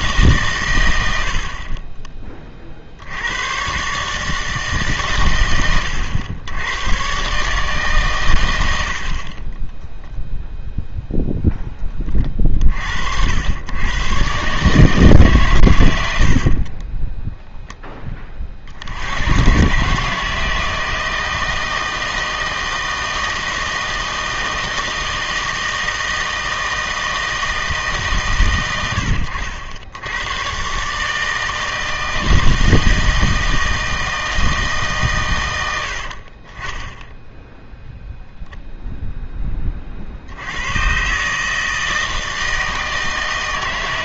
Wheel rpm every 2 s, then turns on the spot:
130, 40, 140, 100, 90, 0, 70, 140, 40, 50, 160, 160, 160, 160, 100, 130, 160, 160, 30, 0, 100, 160.
16-18